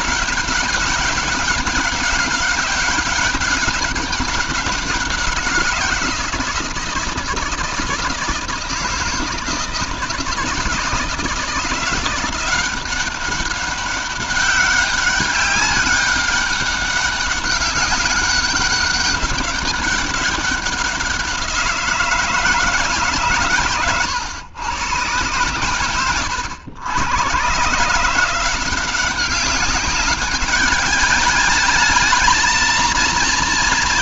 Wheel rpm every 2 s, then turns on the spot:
200, 200, 190, 160, 160, 160, 180, 200, 200, 200, 190, 160, 110, 100, 180, 200, 230.
none